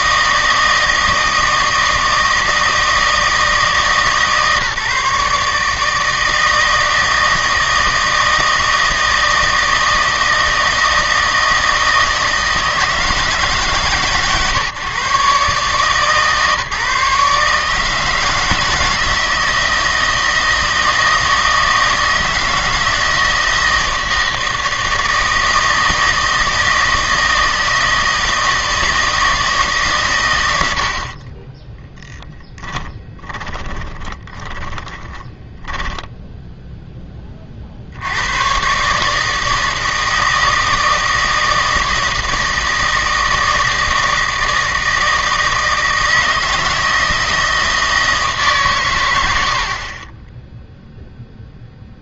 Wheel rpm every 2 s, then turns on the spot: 160, 160, 150, 160, 160, 160, 160, 120, 150, 160, 160, 160, 160, 160, 160, 80, 20, 20, 0, 130, 160, 160, 160, 160, 130, 0.
32-36